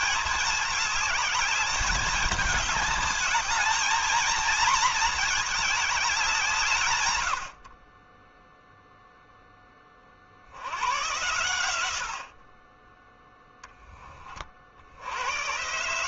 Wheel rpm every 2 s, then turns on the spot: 210, 220, 220, 110, 0, 100, 10, 60.
none